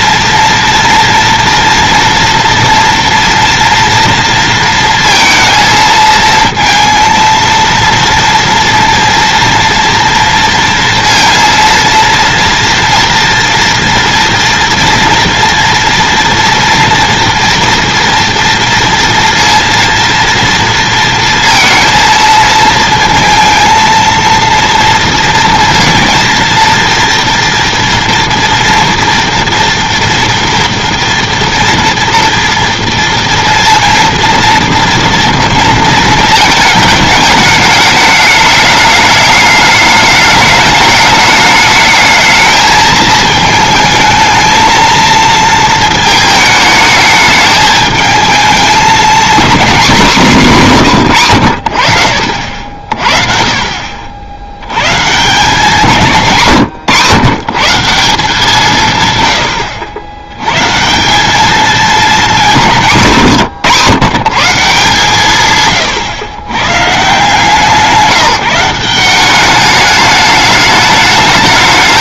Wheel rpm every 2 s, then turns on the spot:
230, 230, 230, 230, 230, 230, 230, 230, 230, 230, 230, 230, 230, 230, 230, 230, 230, 230, 220, 210, 210, 220, 220, 210, 220, 180, 50, 110, 140, 170, 150, 190, 160, 140, 170, 210.
none